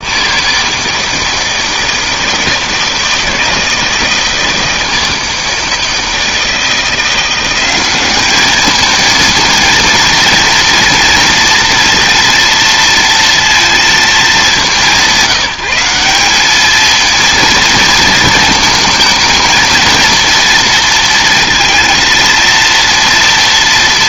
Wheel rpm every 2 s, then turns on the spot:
160, 160, 160, 160, 220, 230, 230, 190, 210, 220, 230, 230.
none